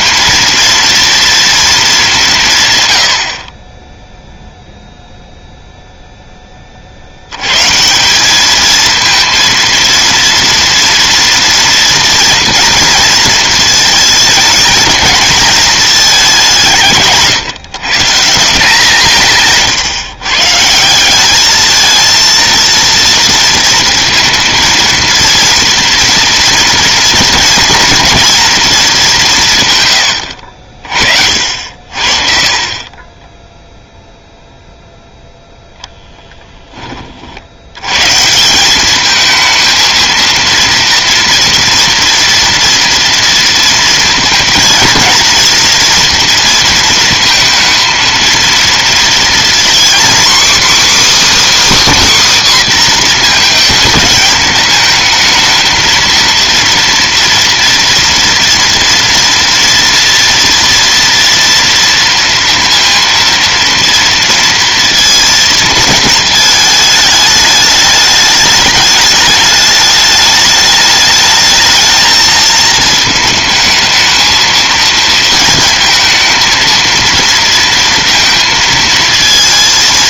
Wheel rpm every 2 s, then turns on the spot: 230, 160, 0, 20, 200, 230, 230, 220, 190, 170, 150, 230, 230, 230, 230, 80, 50, 0, 20, 150, 230, 230, 220, 230, 230, 280, 280, 210, 230, 230, 230, 230, 230, 220, 210, 210, 220, 220, 230, 230.
36-38